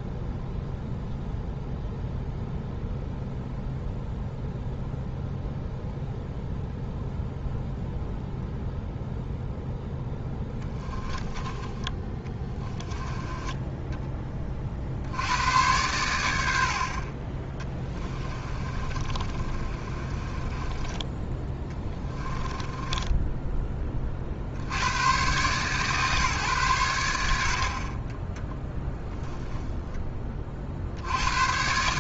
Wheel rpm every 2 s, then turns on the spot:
0, 0, 0, 0, 0, 10, 10, 50, 50, 30, 20, 10, 90, 100, 10, 50.
10-14 18-24